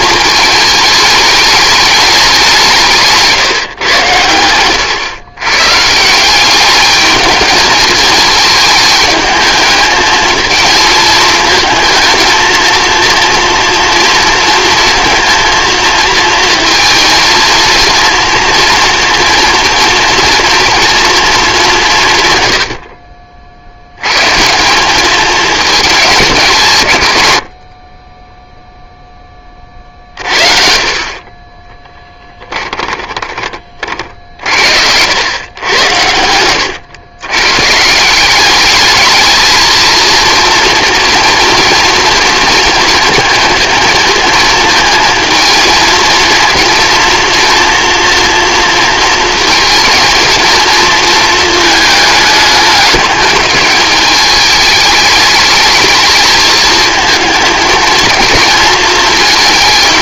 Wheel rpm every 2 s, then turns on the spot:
210, 180, 120, 210, 220, 220, 230, 230, 230, 240, 230, 90, 180, 150, 0, 50, 10, 70, 110, 210, 230, 230, 220, 230, 230, 220, 210, 210, 220, 230.
4-6 32-34